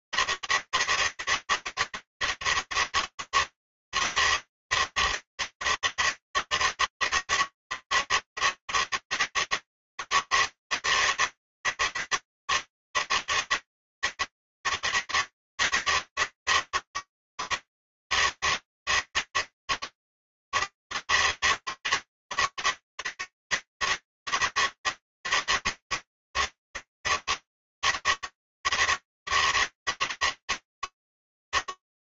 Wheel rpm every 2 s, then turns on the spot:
160, 160, 160, 150, 160, 160, 160, 160, 160, 160, 160, 160, 160, 140, 160, 160.
none